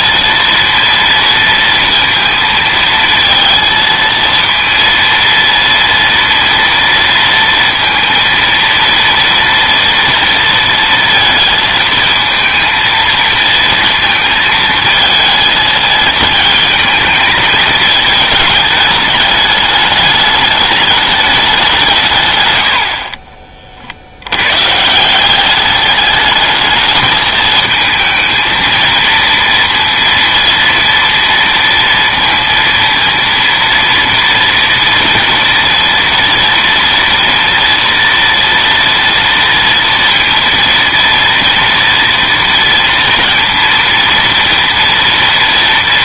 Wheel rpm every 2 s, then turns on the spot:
230, 230, 230, 230, 230, 230, 220, 220, 220, 210, 210, 100, 120, 210, 230, 230, 230, 240, 240, 230, 230, 230, 230.
none